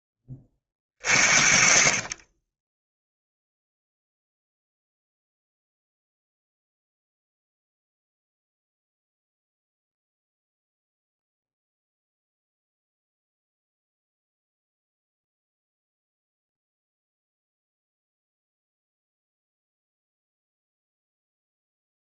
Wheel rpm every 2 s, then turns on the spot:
30, 10, 0, 0, 0, 0, 0, 0, 0, 0, 0.
none